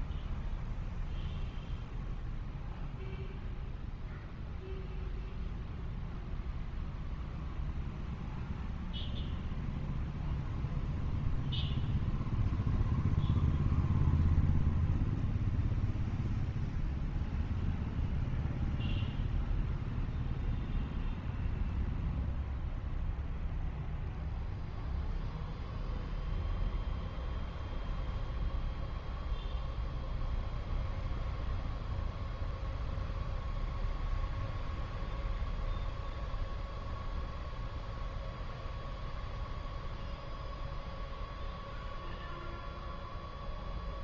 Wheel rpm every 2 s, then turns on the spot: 0, 0, 0, 0, 0, 0, 0, 0, 0, 0, 0, 0, 0, 0, 0, 0, 0, 0, 0, 0, 0, 0.
none